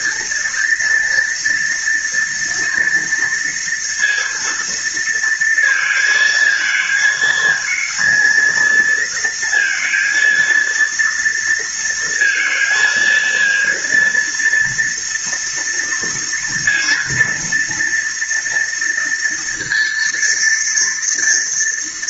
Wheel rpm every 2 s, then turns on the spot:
230, 230, 230, 220, 230, 230, 230, 230, 230, 230, 230.
none